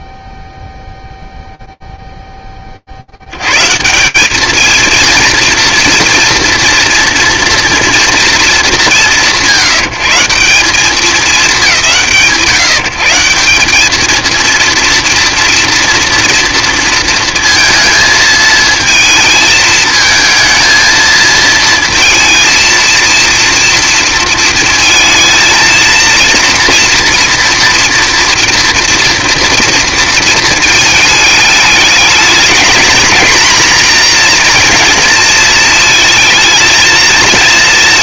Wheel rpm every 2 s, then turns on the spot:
0, 10, 200, 240, 230, 160, 140, 220, 230, 220, 220, 230, 230, 230, 240, 220, 220, 240, 220.
none